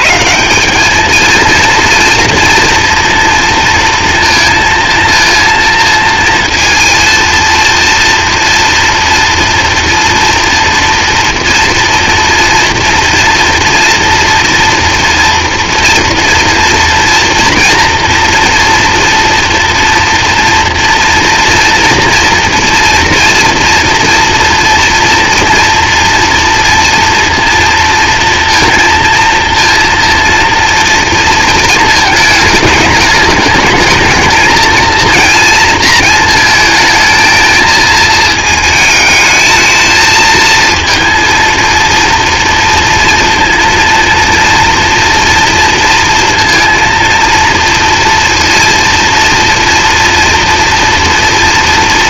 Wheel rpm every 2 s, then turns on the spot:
110, 230, 230, 230, 240, 240, 230, 230, 240, 240, 230, 230, 230, 230, 230, 230, 220, 220, 220, 220, 230, 230, 230, 230, 230, 230.
none